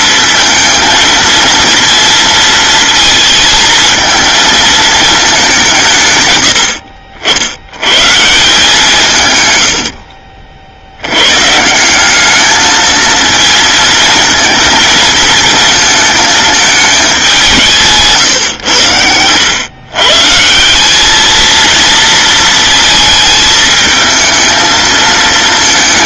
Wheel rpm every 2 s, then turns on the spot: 230, 230, 220, 80, 160, 70, 220, 230, 220, 100, 170, 230, 220.
none